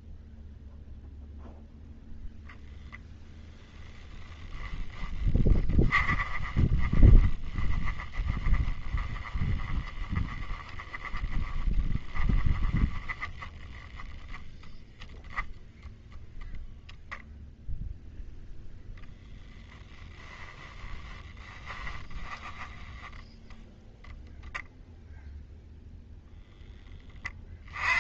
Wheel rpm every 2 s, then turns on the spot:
0, 0, 20, 20, 10, 10, 10, 0, 0, 0, 10, 10, 0, 20.
4-8 20-22